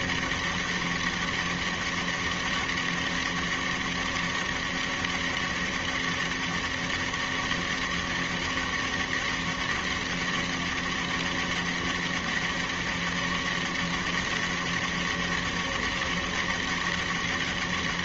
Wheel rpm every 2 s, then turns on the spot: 200, 200, 200, 200, 200, 200, 200, 200, 200.
none